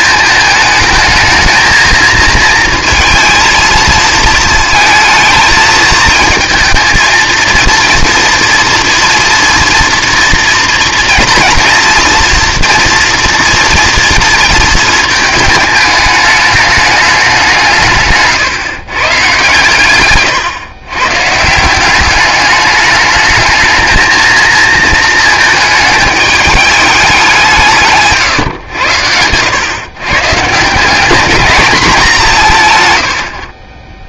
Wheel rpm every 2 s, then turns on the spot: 230, 230, 220, 220, 230, 230, 230, 230, 210, 150, 140, 210, 220, 210, 110, 140, 160.
none